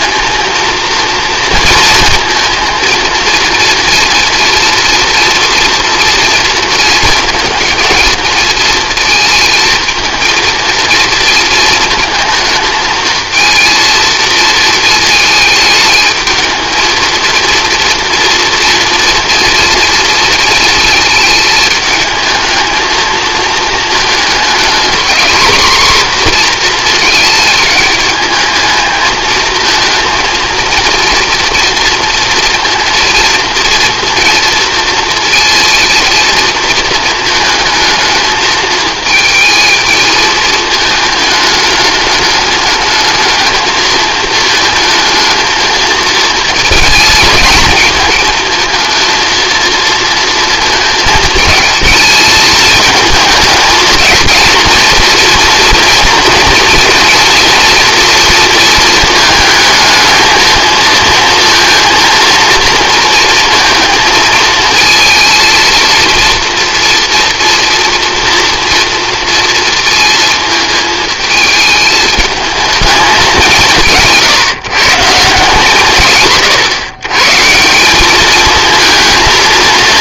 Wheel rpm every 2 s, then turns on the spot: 230, 230, 240, 230, 220, 230, 220, 220, 220, 230, 220, 220, 240, 240, 220, 230, 230, 230, 230, 220, 220, 210, 220, 220, 220, 220, 220, 230, 240, 220, 220, 230, 230, 240, 230, 220, 210, 150, 140, 220.
none